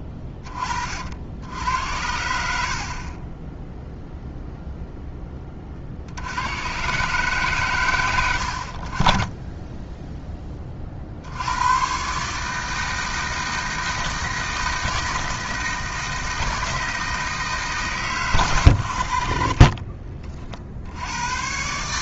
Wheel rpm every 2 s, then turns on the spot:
40, 60, 0, 80, 60, 20, 160, 160, 160, 70, 50.
2-4 18-20